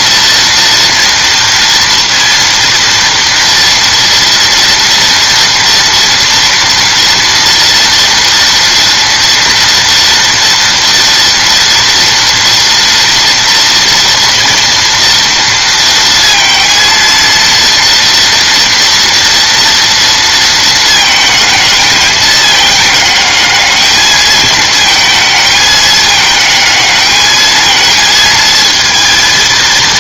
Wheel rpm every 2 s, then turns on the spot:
230, 230, 230, 230, 230, 230, 230, 230, 230, 230, 230, 210, 220, 220, 230.
none